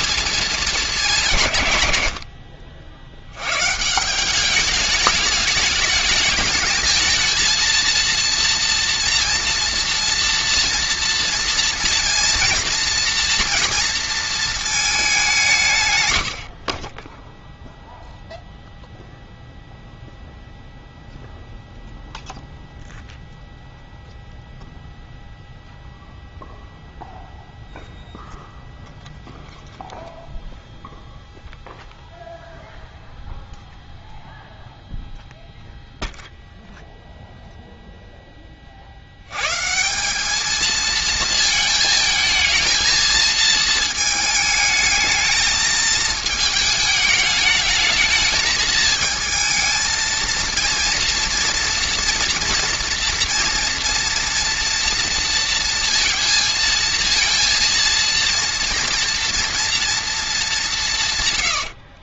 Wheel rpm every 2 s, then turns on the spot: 220, 70, 210, 210, 230, 230, 230, 220, 50, 0, 0, 0, 0, 0, 0, 0, 0, 0, 0, 30, 220, 220, 220, 220, 220, 230, 230, 230, 230, 240, 200.
none